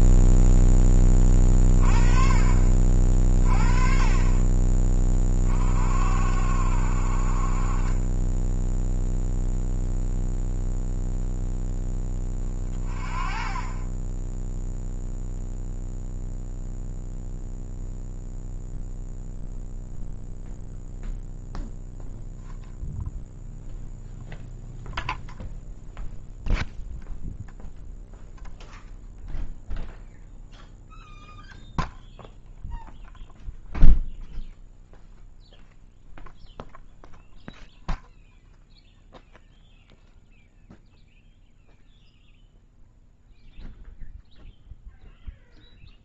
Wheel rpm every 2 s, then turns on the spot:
10, 40, 20, 60, 10, 0, 20, 0, 0, 0, 0, 0, 0, 0, 0, 0, 0, 0, 0, 0, 0, 0, 0.
none